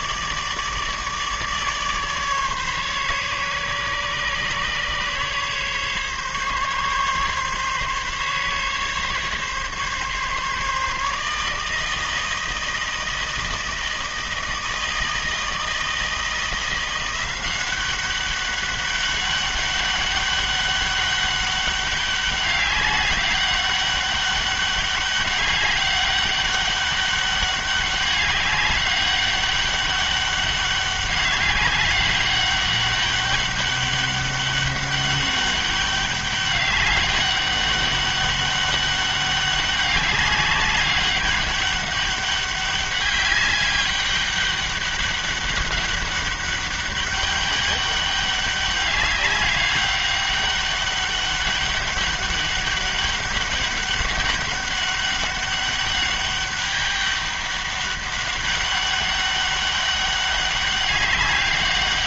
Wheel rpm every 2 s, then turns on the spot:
150, 140, 140, 140, 140, 150, 160, 160, 170, 200, 200, 200, 200, 200, 200, 200, 200, 200, 200, 200, 200, 200, 200, 200, 200, 200, 200, 200, 200, 200, 200.
none